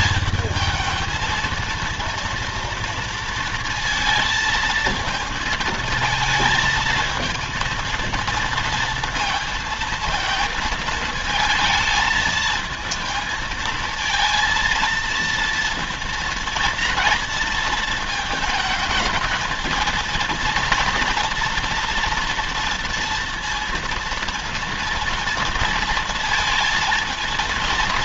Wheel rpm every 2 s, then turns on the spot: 220, 230, 220, 220, 230, 230, 220, 230, 230, 220, 230, 240, 230, 220.
none